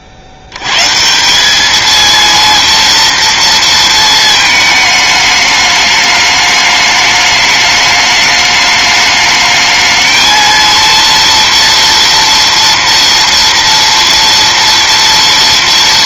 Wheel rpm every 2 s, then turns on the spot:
110, 230, 220, 210, 210, 230, 230, 230.
none